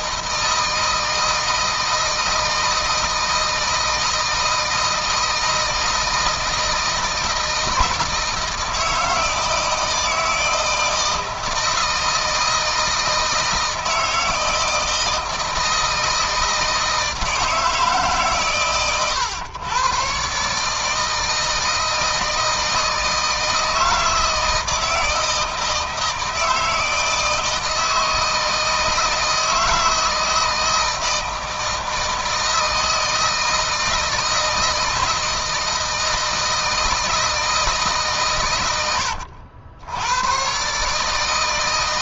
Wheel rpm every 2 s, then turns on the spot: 160, 160, 160, 160, 170, 160, 160, 160, 160, 120, 150, 160, 160, 160, 160, 160, 160, 160, 160, 100, 150.
none